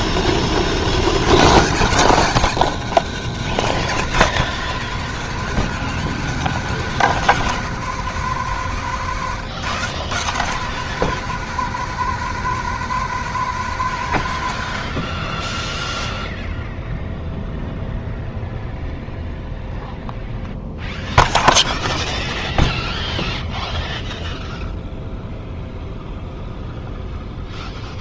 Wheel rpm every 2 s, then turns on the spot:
50, 140, 170, 160, 130, 140, 150, 40, 0, 0, 0, 0, 0, 0.
none